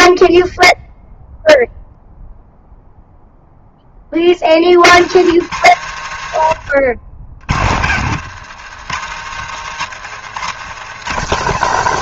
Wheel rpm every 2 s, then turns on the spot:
0, 0, 50, 100, 130, 170.
none